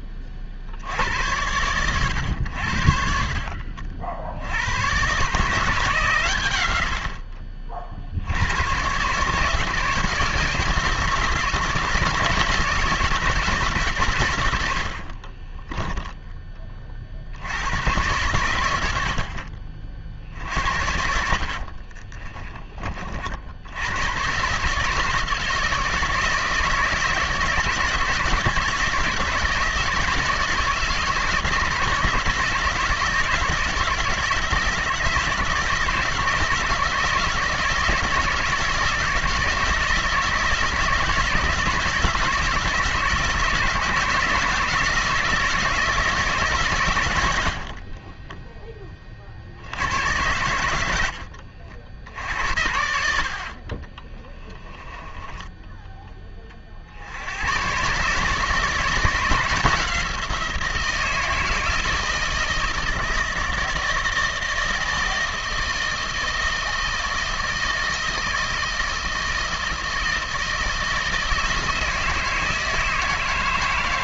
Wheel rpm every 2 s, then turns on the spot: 50, 80, 90, 100, 100, 170, 170, 100, 30, 100, 60, 30, 140, 160, 160, 160, 160, 160, 160, 170, 160, 170, 160, 140, 20, 100, 90, 20, 40, 160, 170, 160, 160, 160, 160, 160, 160.
14-16 20-24 54-56